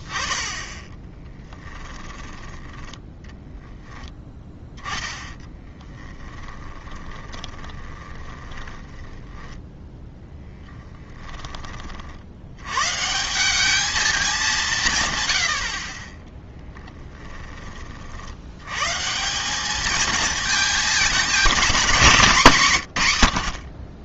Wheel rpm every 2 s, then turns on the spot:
20, 10, 10, 20, 10, 10, 120, 170, 0, 110, 220, 160.
6-12